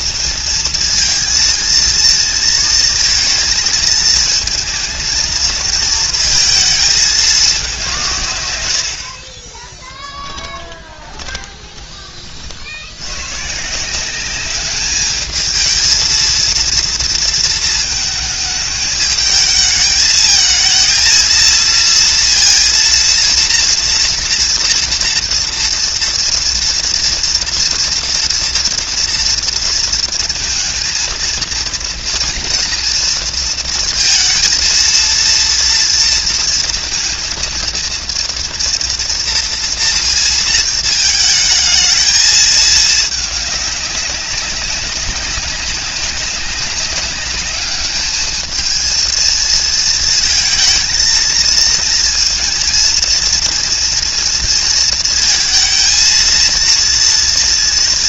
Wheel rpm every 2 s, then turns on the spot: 230, 230, 220, 220, 110, 20, 60, 200, 230, 210, 220, 230, 230, 230, 240, 230, 240, 220, 230, 230, 220, 220, 200, 200, 220, 230, 230, 230, 230.
10-12